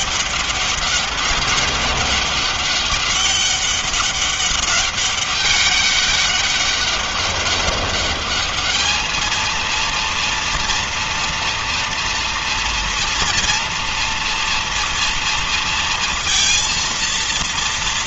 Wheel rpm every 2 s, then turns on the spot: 200, 200, 200, 200, 210, 230, 230, 230, 230.
none